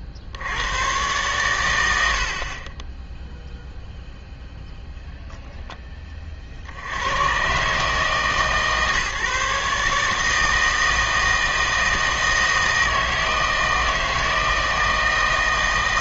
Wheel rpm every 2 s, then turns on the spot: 100, 30, 0, 50, 150, 160, 160, 160.
none